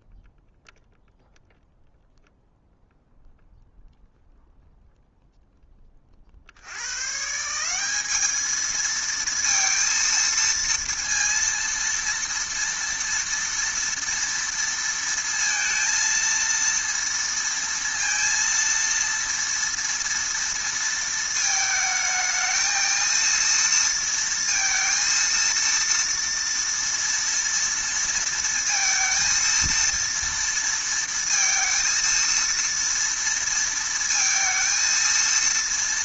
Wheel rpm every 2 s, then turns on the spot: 0, 0, 0, 40, 210, 230, 230, 230, 230, 230, 230, 220, 230, 230, 230, 230, 230, 230.
none